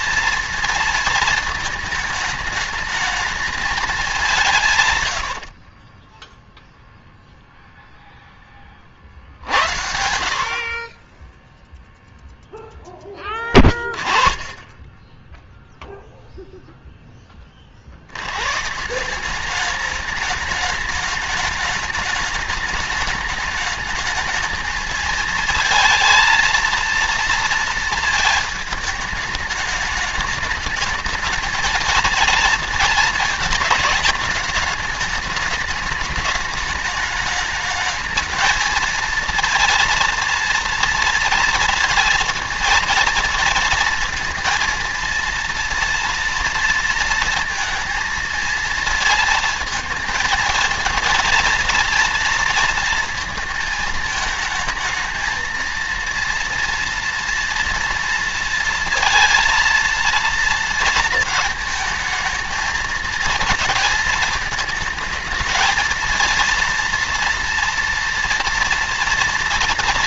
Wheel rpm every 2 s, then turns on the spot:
230, 220, 140, 0, 30, 30, 10, 20, 0, 150, 210, 210, 220, 230, 220, 220, 230, 210, 210, 230, 230, 230, 230, 230, 230, 230, 230, 220, 230, 230, 230, 230, 220, 230, 230.
4-6